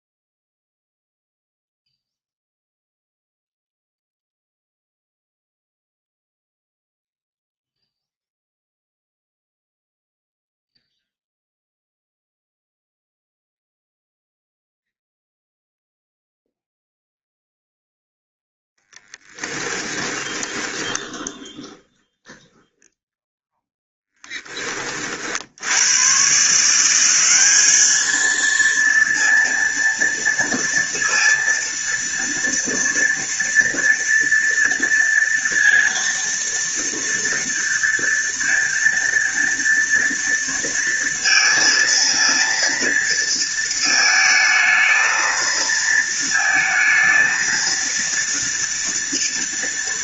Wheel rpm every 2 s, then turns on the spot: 0, 0, 0, 0, 0, 0, 0, 0, 0, 0, 20, 10, 30, 170, 230, 230, 230, 230, 230, 230, 230, 230, 220, 220, 230.
20-24